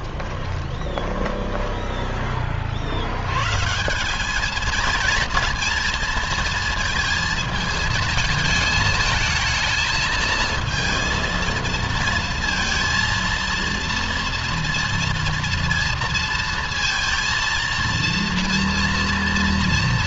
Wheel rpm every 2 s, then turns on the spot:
20, 70, 220, 230, 220, 230, 230, 230, 230, 230.
0-2